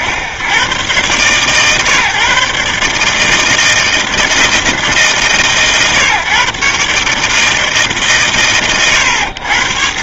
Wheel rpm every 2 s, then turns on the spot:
90, 140, 160, 140, 100.
none